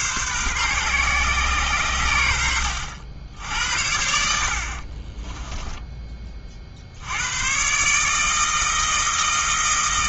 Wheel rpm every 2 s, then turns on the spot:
130, 80, 50, 50, 160.
4-6